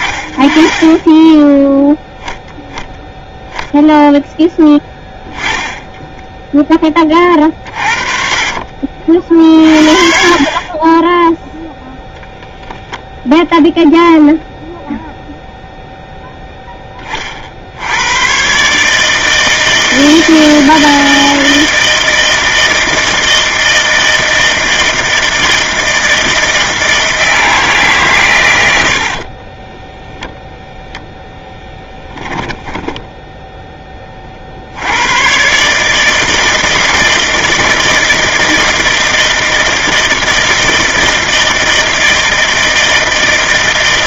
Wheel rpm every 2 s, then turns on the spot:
10, 0, 10, 30, 40, 10, 0, 0, 30, 150, 160, 160, 160, 160, 60, 0, 10, 90, 160, 160, 160, 160.
28-30